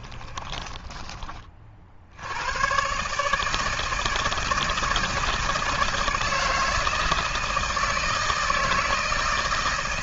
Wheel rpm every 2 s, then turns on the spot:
20, 120, 160, 160, 160.
0-2